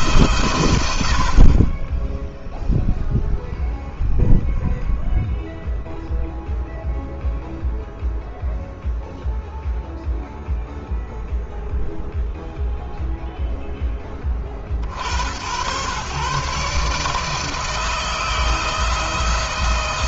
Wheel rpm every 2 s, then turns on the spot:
110, 0, 0, 0, 0, 0, 0, 60, 140, 160.
none